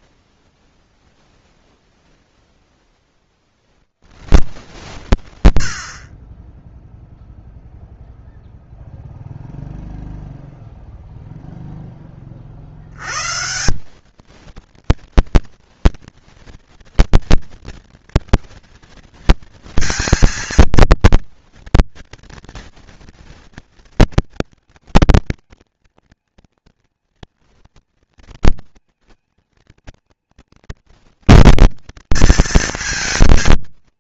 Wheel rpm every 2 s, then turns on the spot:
0, 30, 70, 0, 0, 0, 120, 230, 230, 230, 230, 220, 220, 230, 230, 230, 230.
none